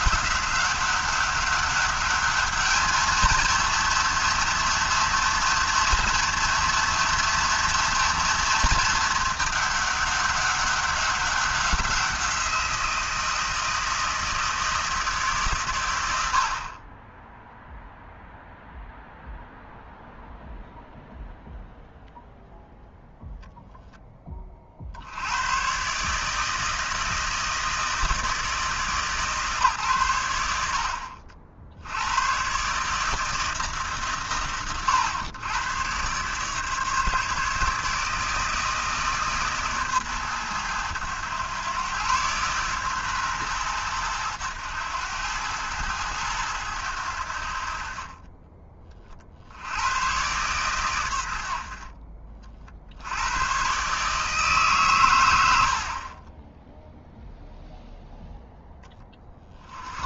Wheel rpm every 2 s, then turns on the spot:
200, 220, 230, 230, 230, 200, 170, 160, 40, 0, 0, 0, 50, 160, 140, 80, 140, 110, 150, 160, 110, 130, 100, 90, 30, 120, 50, 140, 0, 10.
none